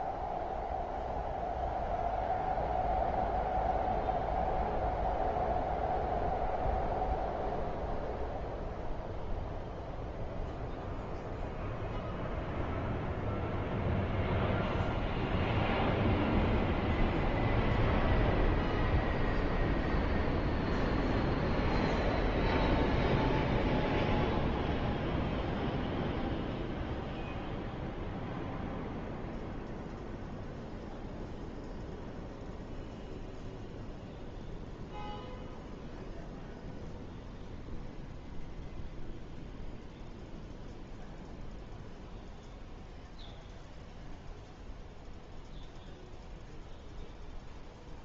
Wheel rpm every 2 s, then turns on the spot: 0, 0, 0, 0, 0, 0, 0, 0, 0, 0, 0, 0, 0, 0, 0, 0, 0, 0, 0, 0, 0, 0, 0, 0.
none